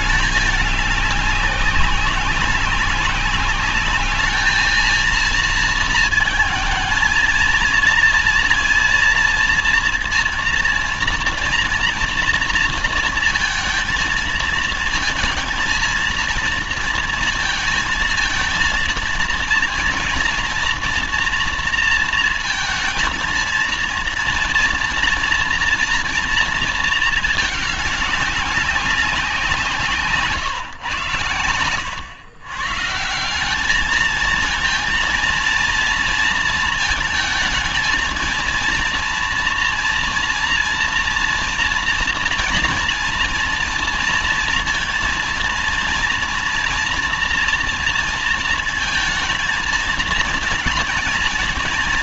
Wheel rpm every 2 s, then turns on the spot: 200, 190, 210, 230, 230, 230, 230, 230, 230, 230, 230, 230, 230, 230, 200, 140, 130, 220, 230, 230, 230, 230, 230, 230, 230, 230.
none